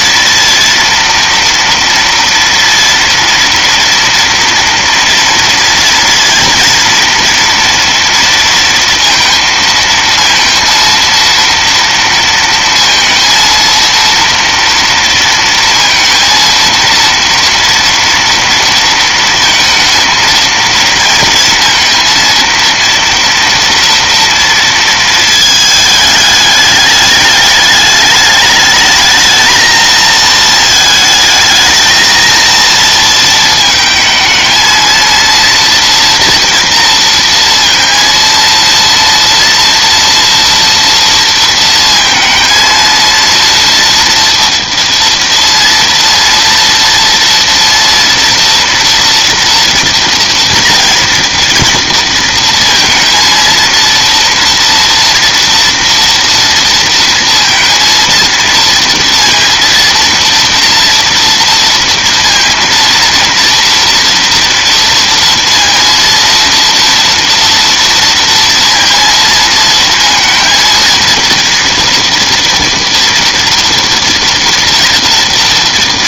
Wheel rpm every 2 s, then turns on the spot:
230, 230, 230, 230, 230, 230, 230, 230, 230, 230, 230, 240, 210, 210, 230, 230, 220, 240, 230, 230, 230, 230, 230, 230, 230, 230, 230, 230, 230, 230, 230, 230, 230, 230, 230, 230, 230, 230.
none